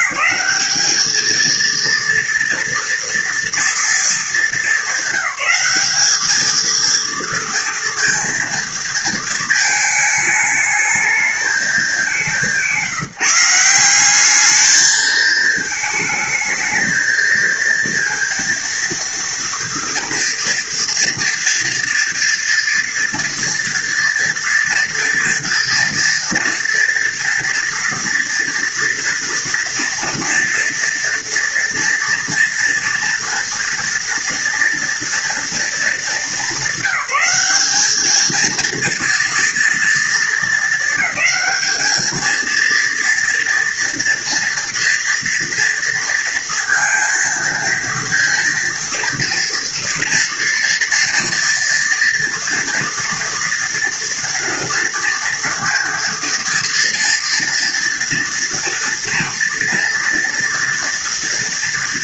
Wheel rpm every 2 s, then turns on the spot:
200, 230, 220, 220, 230, 210, 190, 200, 220, 230, 230, 230, 230, 230, 230, 230, 230, 230, 210, 220, 220, 230, 230, 230, 230, 230, 230, 230, 230, 230, 230.
none